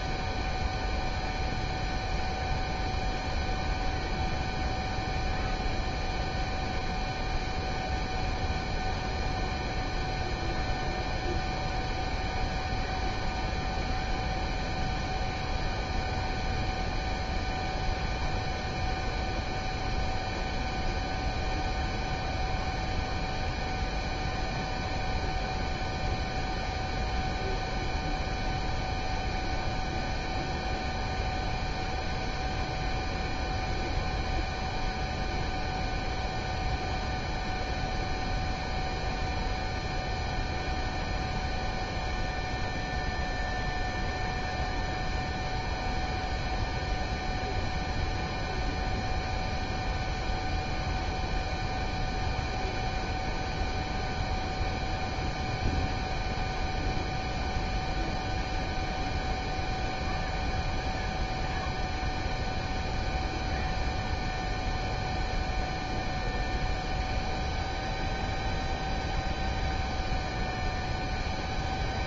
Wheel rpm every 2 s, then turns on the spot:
0, 0, 0, 0, 0, 0, 0, 0, 0, 0, 0, 0, 0, 0, 0, 0, 0, 0, 0, 0, 0, 0, 0, 0, 0, 0, 0, 0, 0, 0, 0, 0, 0, 0, 0, 0.
none